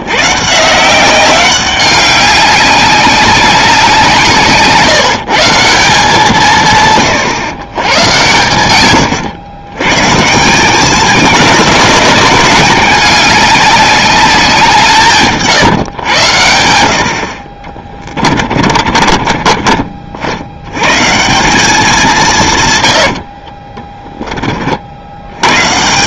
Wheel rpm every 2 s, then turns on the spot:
150, 190, 150, 150, 120, 180, 200, 180, 90, 40, 100, 130, 40.
18-20 22-24